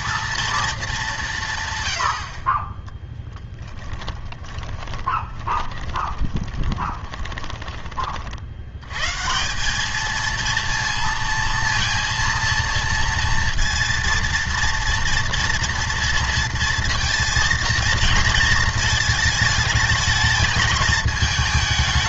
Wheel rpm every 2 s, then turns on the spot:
220, 20, 20, 20, 100, 230, 230, 230, 230, 220, 210.
4-8